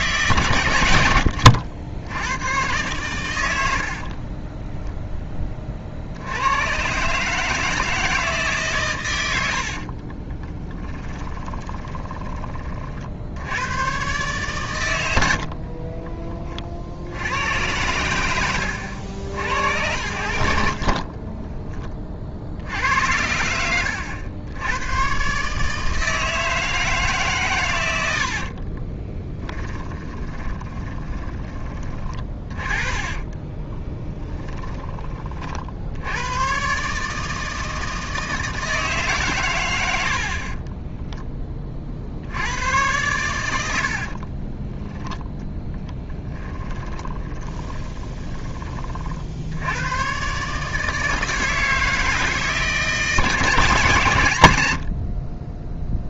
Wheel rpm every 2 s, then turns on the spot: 110, 110, 20, 110, 140, 30, 40, 110, 50, 80, 50, 60, 90, 160, 40, 20, 20, 20, 140, 160, 20, 100, 20, 10, 40, 150, 160, 90.
4-6 10-12 20-22 28-34 40-42 44-48 54-56